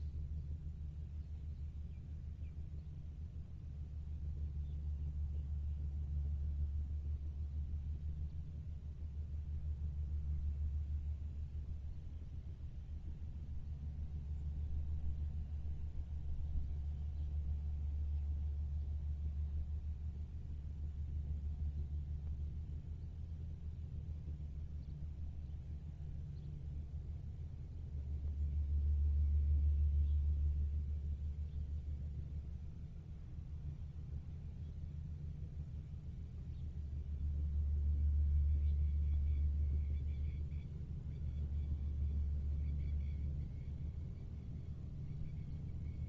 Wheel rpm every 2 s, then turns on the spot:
0, 0, 0, 0, 0, 0, 0, 0, 0, 0, 0, 0, 0, 0, 0, 0, 0, 0, 0, 0, 0, 0, 0.
none